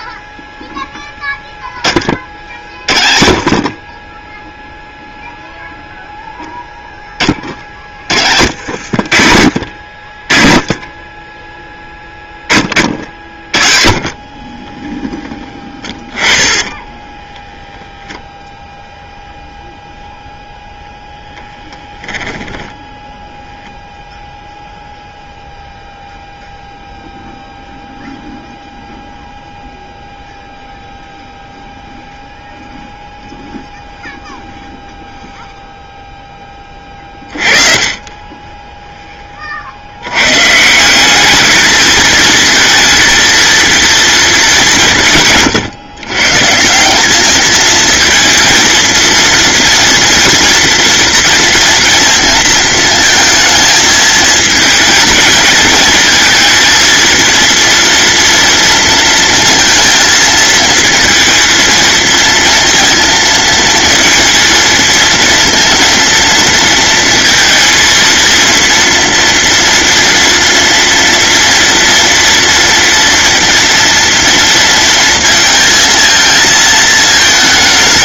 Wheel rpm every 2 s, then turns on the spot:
0, 30, 0, 0, 50, 30, 50, 20, 10, 0, 0, 10, 0, 0, 0, 0, 0, 0, 30, 20, 170, 230, 190, 170, 230, 230, 230, 220, 230, 230, 230, 230, 230, 230, 230, 230, 230, 230, 220.
8-18